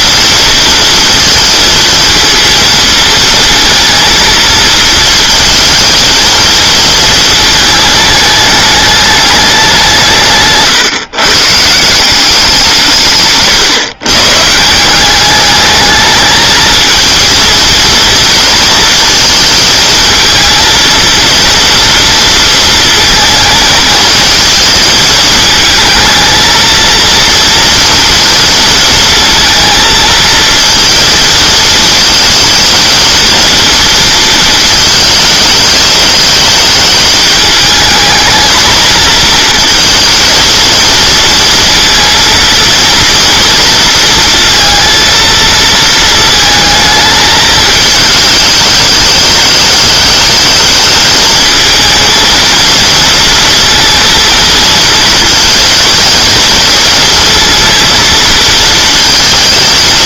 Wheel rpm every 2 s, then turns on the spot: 230, 230, 220, 230, 210, 140, 170, 160, 220, 230, 230, 230, 230, 230, 230, 230, 230, 230, 210, 220, 230, 230, 230, 220, 210, 220, 230, 230, 230, 220.
none